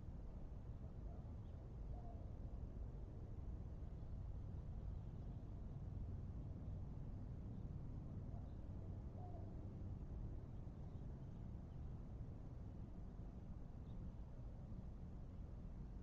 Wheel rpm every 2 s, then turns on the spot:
0, 0, 0, 0, 0, 0, 0, 0.
none